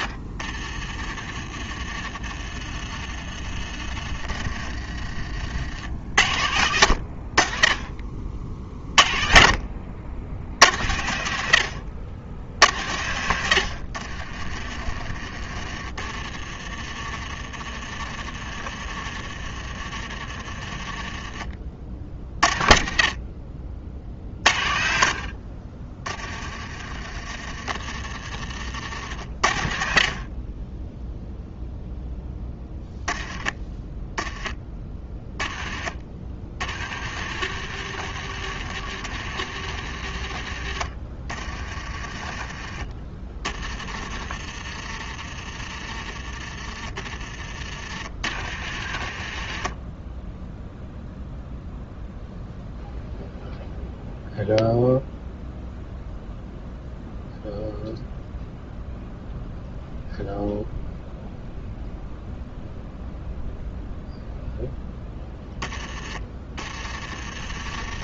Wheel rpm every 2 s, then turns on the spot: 40, 30, 30, 80, 40, 80, 80, 40, 40, 40, 30, 50, 50, 40, 50, 20, 10, 20, 50, 70, 50, 30, 30, 30, 50, 0, 0, 0, 0, 0, 0, 0, 0, 30.
0-6 14-22 42-44 66-68